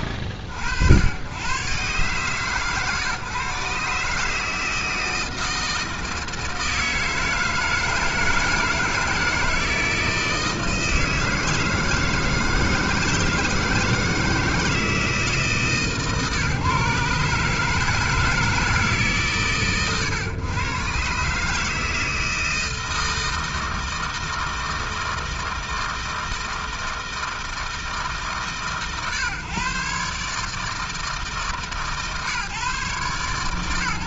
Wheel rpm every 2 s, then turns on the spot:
60, 130, 160, 160, 160, 160, 160, 160, 150, 160, 120, 160, 160, 160, 130, 150, 140.
none